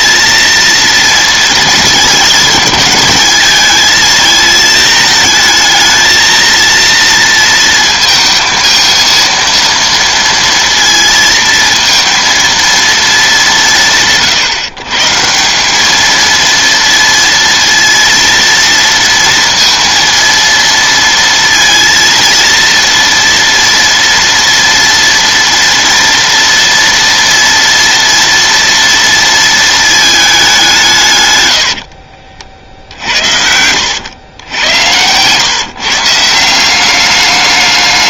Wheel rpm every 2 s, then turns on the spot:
230, 210, 220, 230, 230, 230, 230, 130, 230, 230, 230, 230, 230, 230, 230, 190, 50, 100, 180.
32-34